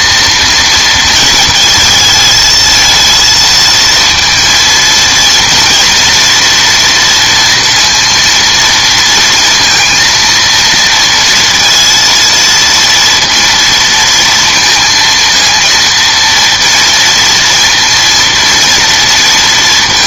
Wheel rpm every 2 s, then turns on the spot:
230, 220, 230, 240, 230, 230, 230, 230, 230, 230.
none